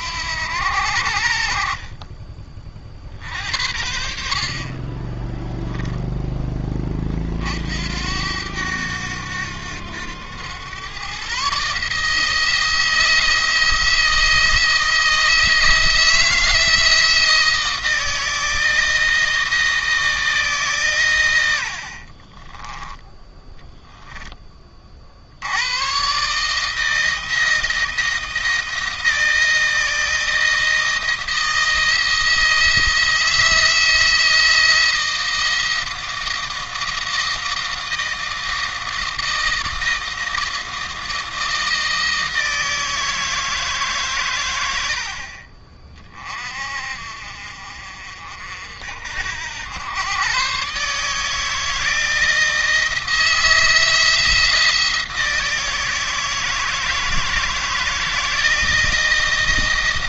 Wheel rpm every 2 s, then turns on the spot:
70, 40, 50, 20, 90, 110, 160, 170, 160, 160, 150, 20, 30, 160, 170, 170, 160, 170, 160, 160, 160, 160, 90, 40, 60, 140, 160, 170, 160, 170.
22-24